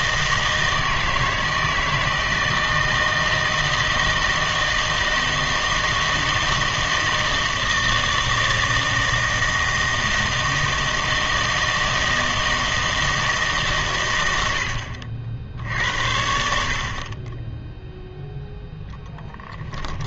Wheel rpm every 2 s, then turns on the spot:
160, 160, 160, 160, 160, 160, 160, 80, 60, 0.
none